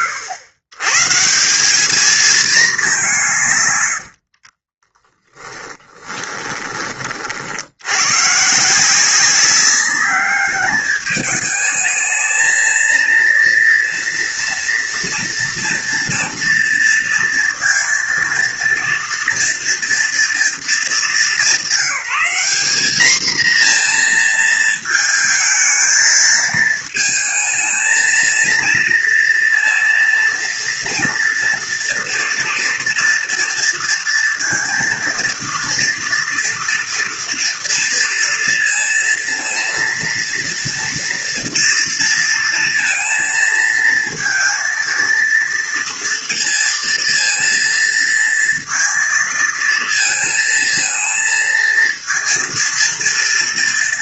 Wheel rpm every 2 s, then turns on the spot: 110, 210, 30, 30, 150, 210, 220, 230, 230, 230, 220, 220, 220, 220, 230, 230, 230, 230, 230, 230, 230, 230, 230, 230, 230, 230, 230.
4-6